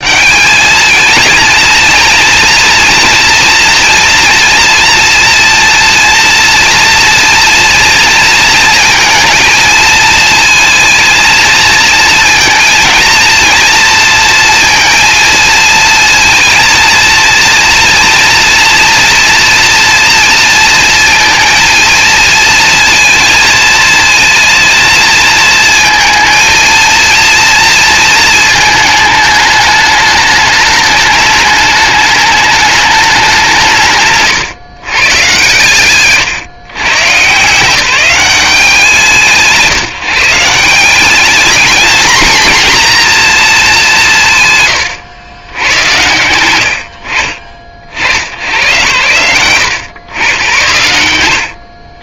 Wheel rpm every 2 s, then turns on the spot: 220, 230, 230, 230, 230, 230, 230, 230, 230, 230, 230, 230, 220, 230, 220, 210, 200, 130, 130, 180, 190, 240, 130, 80, 120, 100.
none